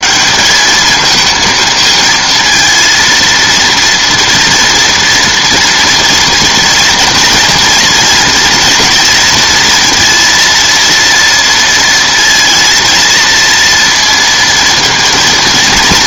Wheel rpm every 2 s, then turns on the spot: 210, 230, 240, 230, 230, 230, 230, 230.
none